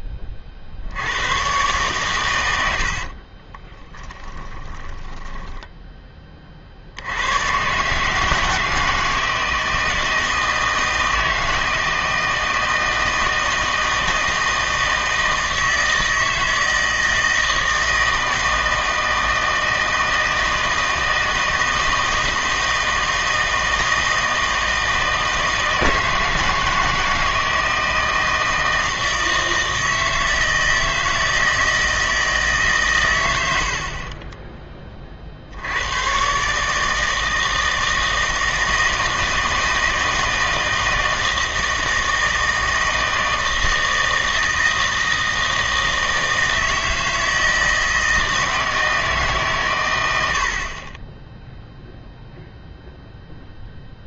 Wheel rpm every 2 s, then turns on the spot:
50, 90, 20, 50, 160, 160, 160, 160, 160, 160, 160, 160, 160, 160, 160, 160, 140, 20, 150, 160, 160, 160, 160, 160, 160, 50, 0.
4-6